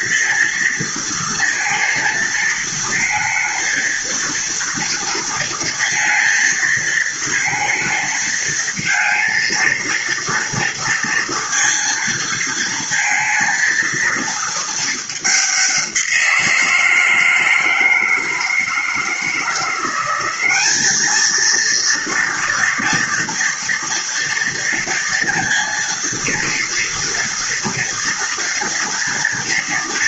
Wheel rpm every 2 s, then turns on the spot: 230, 230, 230, 230, 230, 230, 230, 210, 160, 160, 220, 230, 230, 230, 230.
none